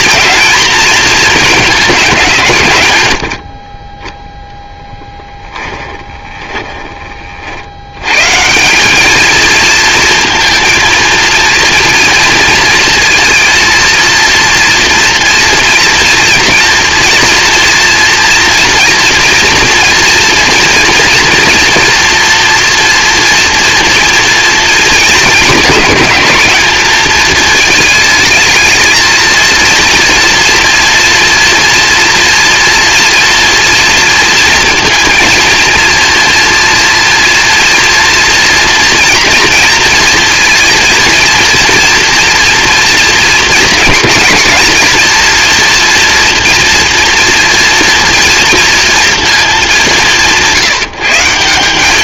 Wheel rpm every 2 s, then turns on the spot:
220, 110, 10, 30, 190, 230, 230, 230, 230, 240, 240, 230, 220, 220, 220, 230, 230, 230, 240, 240, 230, 230, 230, 240, 230, 170.
2-6